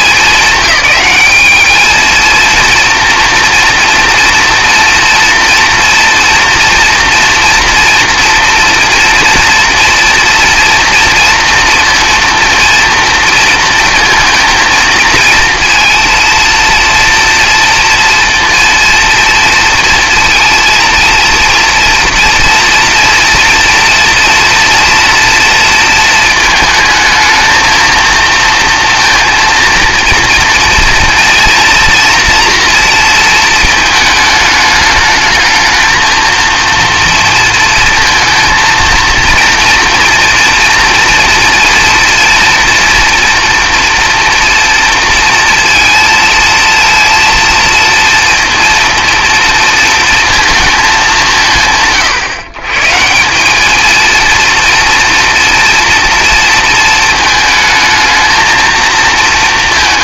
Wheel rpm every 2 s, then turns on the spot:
190, 230, 230, 230, 230, 230, 230, 230, 230, 230, 230, 230, 230, 220, 230, 230, 230, 210, 230, 230, 230, 230, 230, 230, 230, 220, 140, 230, 220, 230.
none